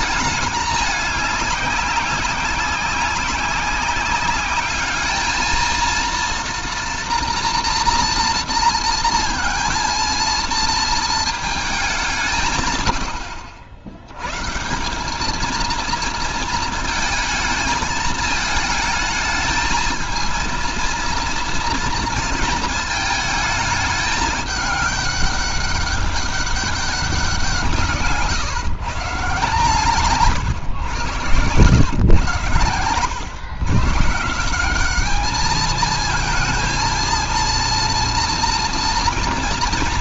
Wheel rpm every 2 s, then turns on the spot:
210, 190, 200, 230, 230, 230, 130, 170, 220, 220, 230, 220, 210, 200, 140, 120, 120, 190, 220, 240.
30-32